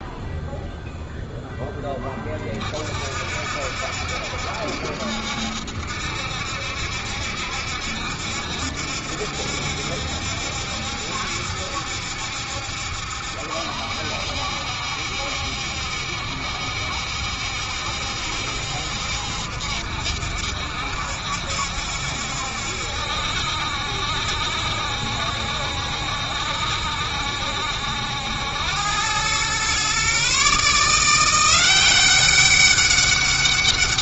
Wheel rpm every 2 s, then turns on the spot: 0, 50, 70, 70, 70, 70, 70, 70, 70, 70, 70, 70, 70, 70, 100, 160, 200.
none